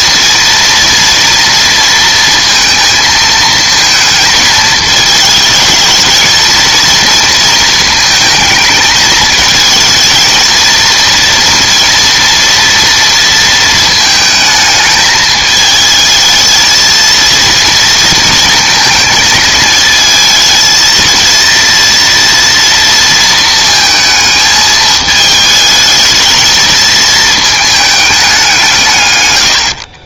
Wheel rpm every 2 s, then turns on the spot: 240, 230, 220, 230, 220, 230, 230, 220, 230, 220, 230, 230, 220, 220, 120.
none